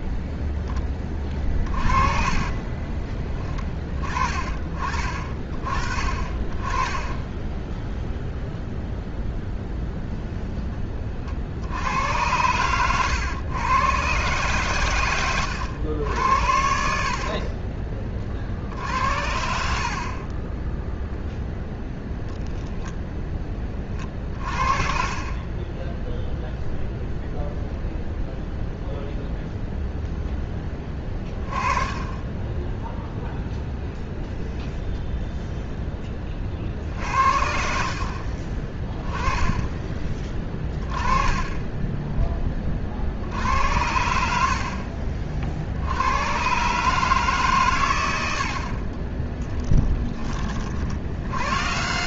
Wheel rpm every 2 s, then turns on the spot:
10, 20, 30, 10, 0, 30, 110, 80, 50, 60, 10, 0, 30, 0, 0, 10, 10, 0, 40, 30, 20, 20, 70, 110, 60, 30.
2-4 24-26 48-50